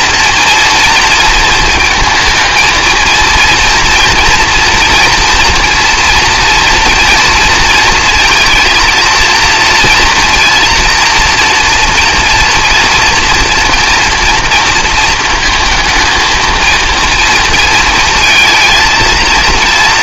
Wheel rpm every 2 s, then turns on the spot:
230, 230, 240, 230, 230, 230, 230, 230, 230, 230.
none